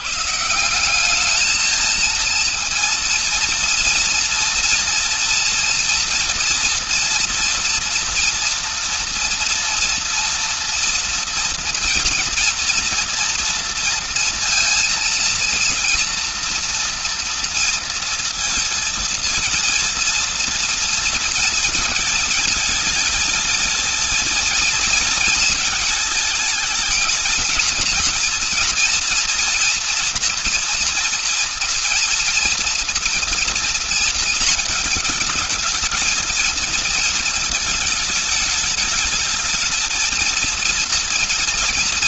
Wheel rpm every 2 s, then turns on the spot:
170, 230, 240, 230, 230, 230, 240, 230, 230, 230, 230, 220, 230, 220, 230, 240, 230, 220, 230, 220, 230.
none